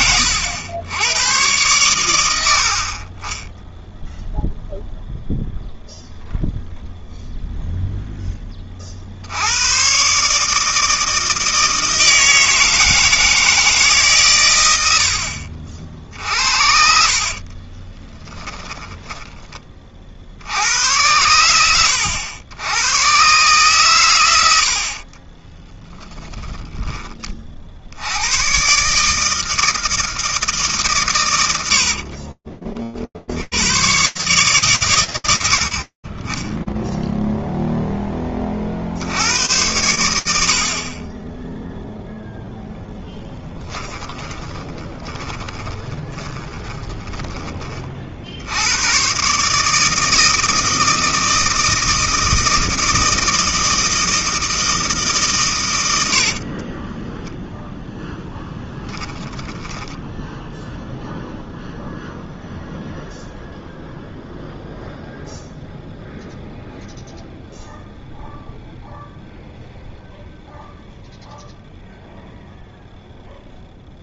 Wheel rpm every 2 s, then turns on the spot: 100, 40, 0, 0, 50, 160, 160, 90, 60, 30, 90, 110, 60, 30, 140, 130, 20, 130, 10, 30, 80, 0, 20, 20, 130, 160, 160, 150, 10, 10, 0, 0, 0, 0, 0, 0, 0.
16-20 24-26 44-48 56-60